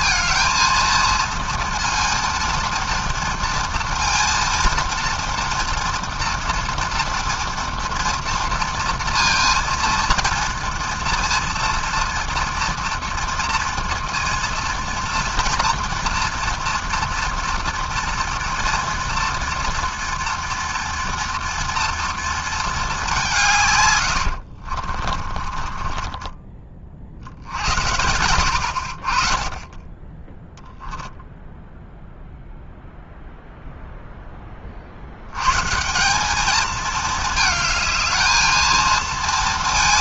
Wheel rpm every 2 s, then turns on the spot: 230, 230, 230, 230, 230, 230, 230, 230, 230, 240, 240, 190, 40, 60, 30, 0, 0, 90, 220, 230.
24-26